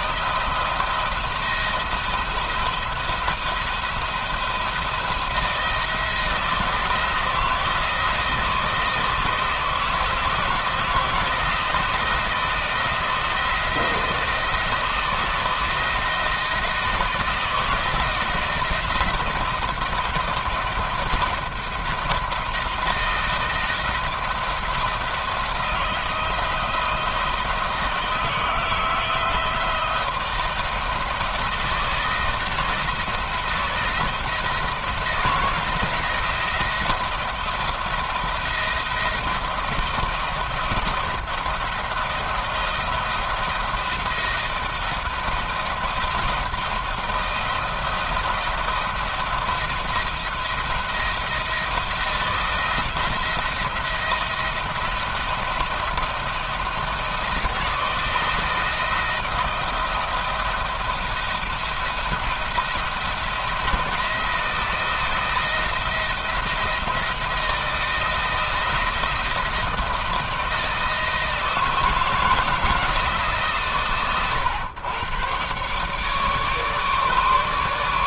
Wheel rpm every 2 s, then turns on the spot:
170, 170, 170, 170, 170, 170, 170, 160, 160, 160, 170, 160, 170, 160, 160, 160, 170, 170, 170, 160, 170, 170, 170, 170, 170, 170, 170, 170, 170, 170, 170, 170, 170, 170, 160, 160, 160, 100, 150.
none